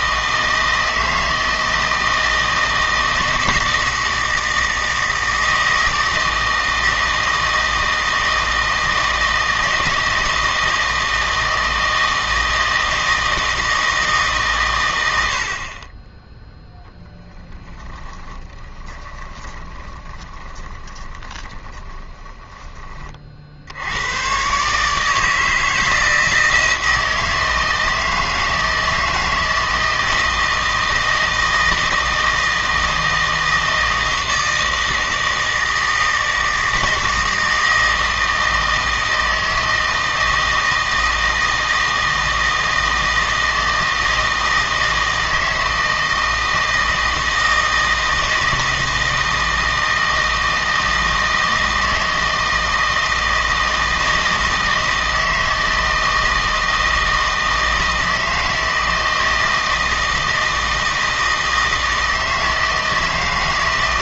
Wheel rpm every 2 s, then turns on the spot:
160, 160, 160, 160, 160, 160, 160, 120, 0, 20, 20, 30, 150, 160, 160, 160, 160, 160, 160, 160, 160, 160, 160, 160, 160, 160, 160, 160, 160, 160, 160, 160.
18-22